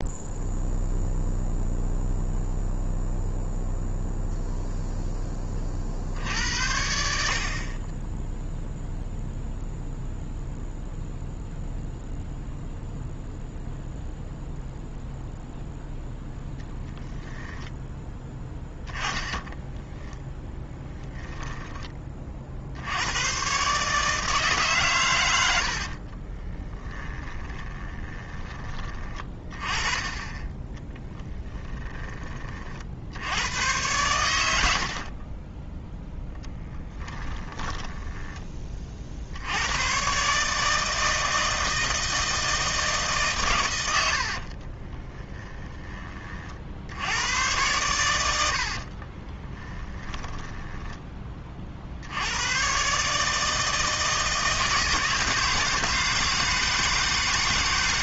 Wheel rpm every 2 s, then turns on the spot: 0, 0, 0, 70, 0, 0, 0, 0, 0, 10, 10, 70, 130, 10, 20, 10, 50, 70, 10, 40, 160, 160, 30, 60, 60, 10, 120, 160, 160.
18-22 26-28 30-32 34-38 44-46 48-52